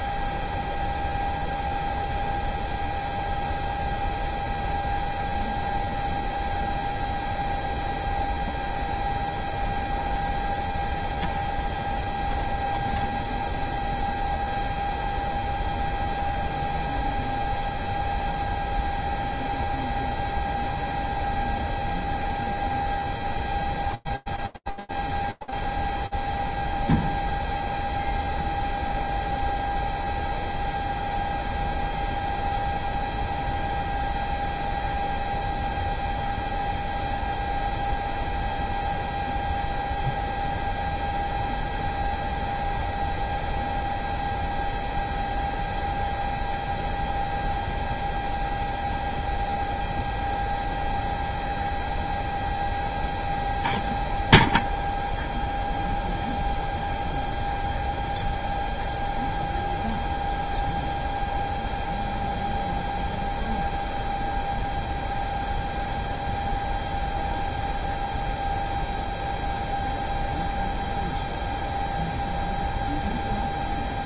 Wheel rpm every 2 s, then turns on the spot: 0, 0, 0, 0, 0, 0, 0, 0, 0, 0, 0, 0, 0, 0, 0, 0, 0, 0, 0, 0, 0, 0, 0, 0, 0, 0, 0, 0, 0, 0, 0, 0, 0, 0, 0, 0, 0.
none